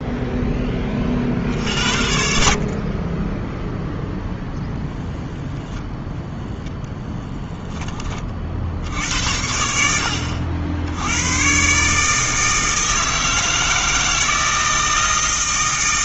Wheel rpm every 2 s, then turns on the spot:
20, 50, 0, 0, 60, 80, 160, 160.
none